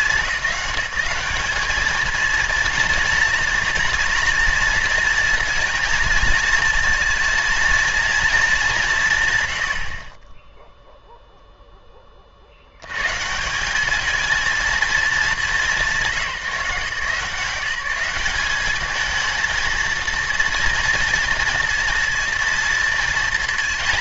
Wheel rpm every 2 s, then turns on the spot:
200, 230, 230, 230, 170, 0, 110, 220, 160, 220, 230, 220.
none